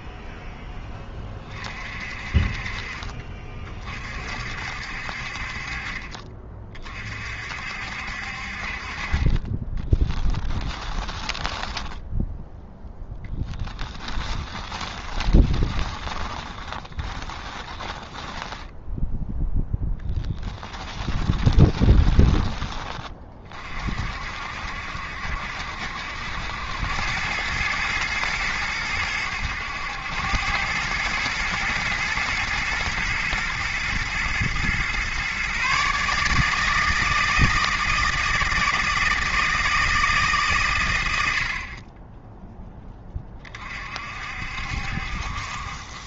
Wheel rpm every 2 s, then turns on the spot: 20, 40, 60, 40, 40, 10, 0, 20, 20, 0, 10, 20, 60, 90, 100, 100, 110, 120, 160, 170, 120, 10, 60.
10-12 14-18 20-22